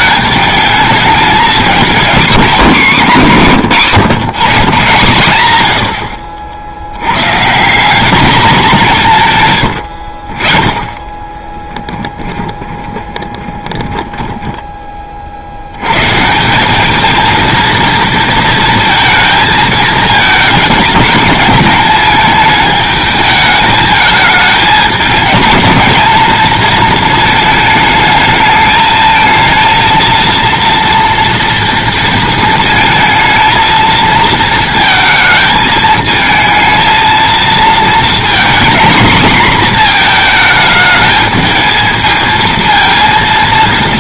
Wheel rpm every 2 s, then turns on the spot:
220, 220, 120, 90, 190, 20, 30, 20, 200, 230, 220, 210, 210, 220, 220, 230, 230, 230, 220, 250, 220, 230.
12-14